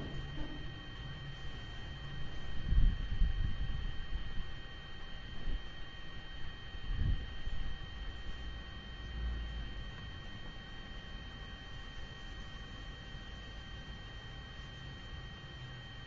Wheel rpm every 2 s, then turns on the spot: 0, 0, 0, 0, 0, 0, 0, 0.
none